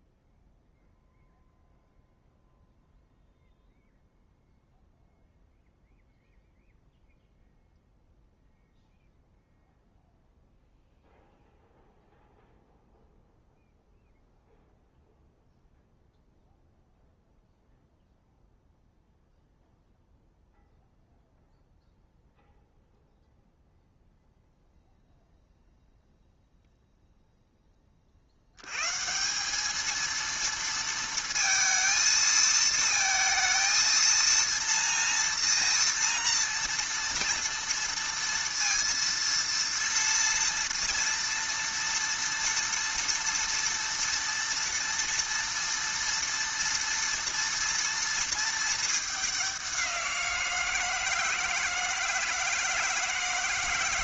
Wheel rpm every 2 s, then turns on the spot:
0, 0, 0, 0, 0, 0, 0, 0, 0, 0, 0, 0, 0, 0, 100, 230, 220, 230, 230, 230, 230, 230, 230, 230, 220, 170, 160.
none